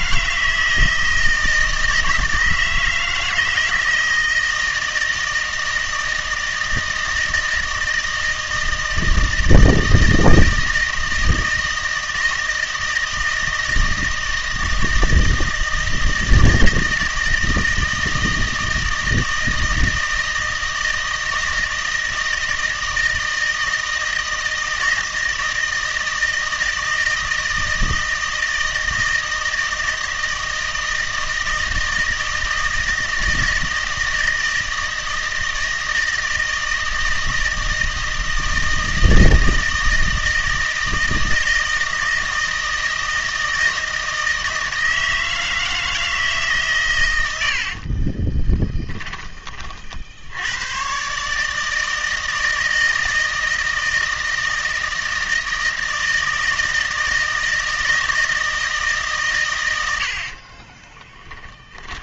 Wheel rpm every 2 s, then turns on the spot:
160, 160, 160, 160, 160, 160, 160, 160, 160, 160, 160, 160, 160, 160, 160, 160, 160, 160, 160, 160, 160, 160, 160, 140, 20, 110, 160, 160, 160, 150, 20.
48-50 60-62